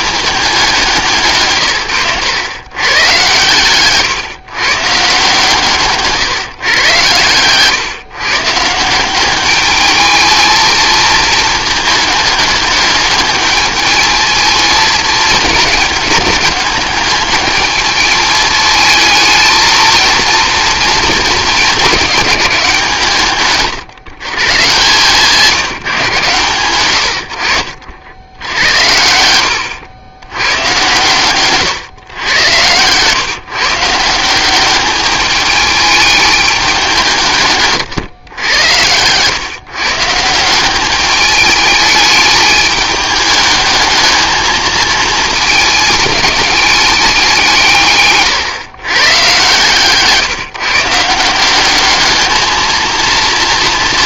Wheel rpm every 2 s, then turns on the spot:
190, 120, 140, 130, 150, 220, 210, 220, 210, 220, 220, 180, 140, 100, 80, 110, 120, 190, 200, 100, 180, 210, 220, 210, 140, 150, 230.
none